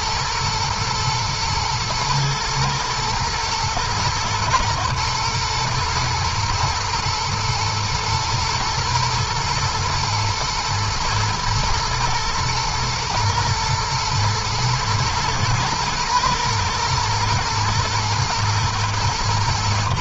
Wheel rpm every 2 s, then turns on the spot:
110, 110, 110, 110, 110, 110, 120, 120, 120, 120.
none